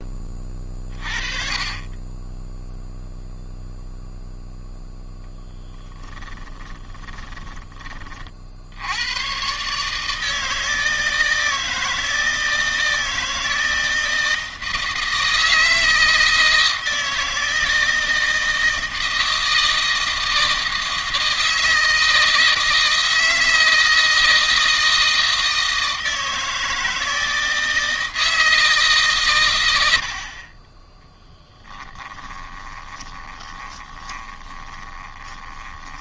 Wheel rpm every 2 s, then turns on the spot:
20, 0, 0, 10, 70, 160, 160, 160, 160, 160, 160, 160, 160, 160, 150, 30, 20, 20.
6-8 32-36